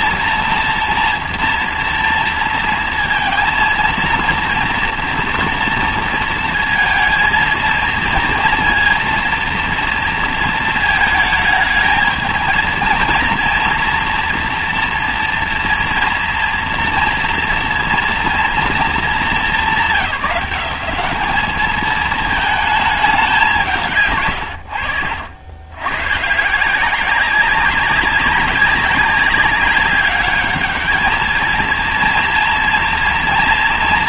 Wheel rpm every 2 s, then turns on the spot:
240, 230, 230, 230, 230, 220, 230, 230, 230, 230, 190, 220, 80, 170, 190, 210, 230.
none